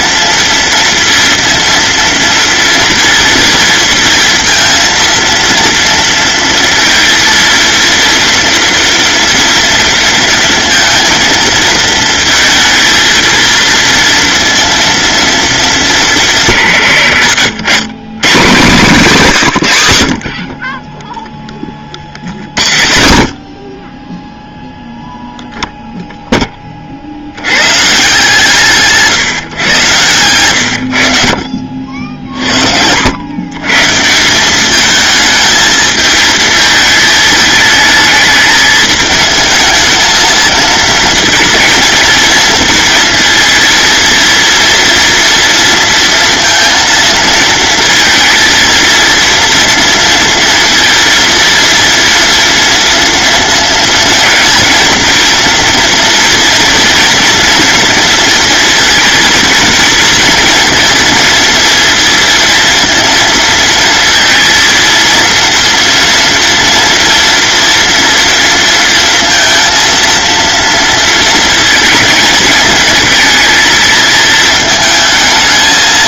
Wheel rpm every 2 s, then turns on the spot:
230, 230, 230, 230, 230, 230, 230, 230, 130, 160, 30, 70, 0, 50, 160, 80, 80, 220, 220, 220, 220, 220, 230, 230, 230, 230, 230, 230, 230, 230, 240, 230, 230, 230, 230, 230, 220, 220.
none